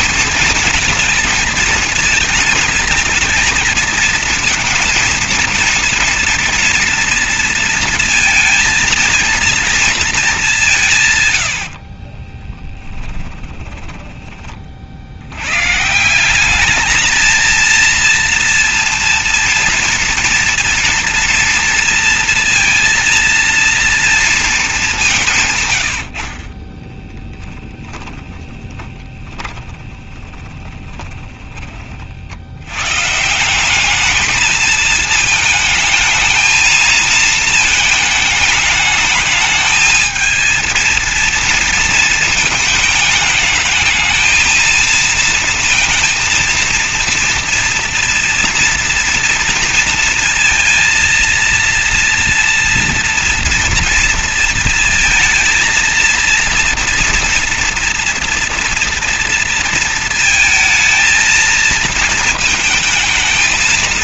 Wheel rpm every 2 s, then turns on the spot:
220, 220, 230, 230, 230, 170, 20, 30, 210, 230, 230, 230, 200, 20, 30, 20, 110, 220, 220, 210, 220, 210, 230, 230, 230, 230, 230, 230, 230, 230, 230, 220.
12-14 26-32